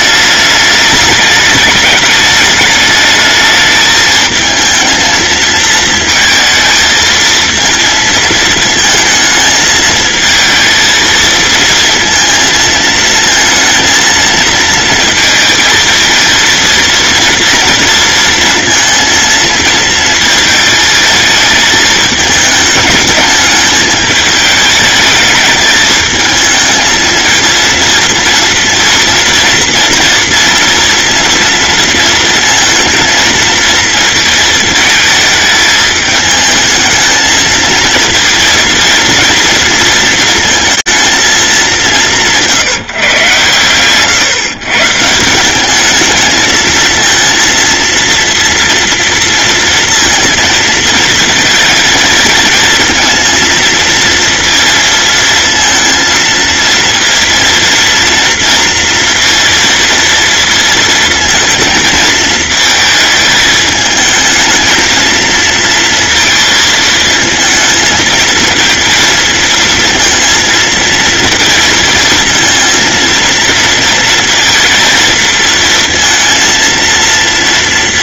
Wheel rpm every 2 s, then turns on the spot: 210, 210, 220, 220, 220, 230, 220, 230, 230, 230, 220, 210, 220, 220, 230, 230, 230, 220, 220, 230, 230, 150, 150, 220, 230, 230, 230, 230, 230, 230, 230, 220, 230, 220, 230, 230, 230, 230, 230.
none